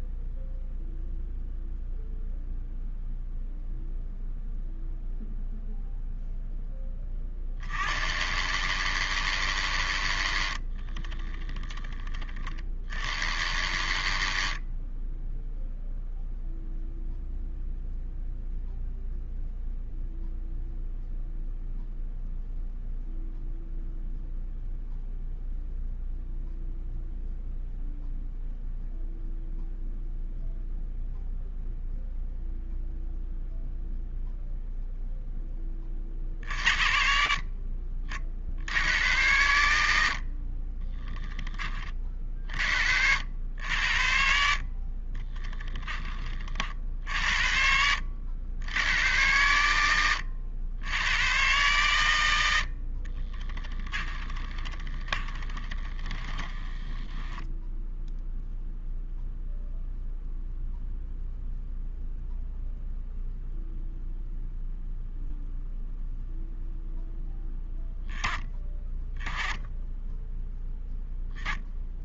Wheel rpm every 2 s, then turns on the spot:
0, 0, 0, 20, 80, 20, 50, 10, 0, 0, 0, 0, 0, 0, 0, 0, 0, 0, 60, 90, 20, 70, 30, 60, 90, 100, 40, 20, 10, 0, 0, 0, 0, 0, 20, 10.
40-42 44-46 52-58